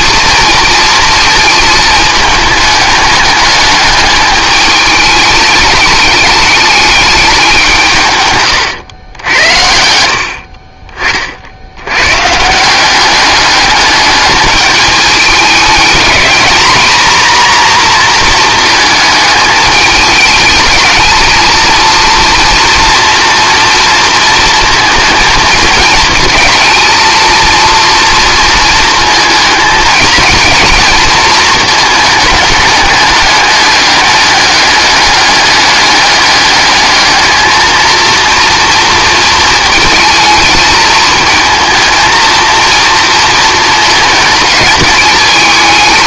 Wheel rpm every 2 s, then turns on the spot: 230, 210, 210, 210, 120, 50, 170, 210, 230, 230, 220, 240, 230, 220, 230, 220, 220, 210, 210, 230, 220, 230, 220.
none